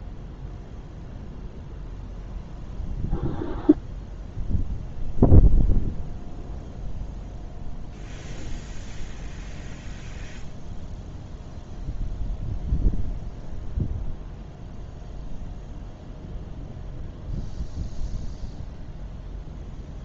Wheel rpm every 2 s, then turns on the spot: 0, 0, 0, 0, 0, 0, 0, 0, 0, 0.
none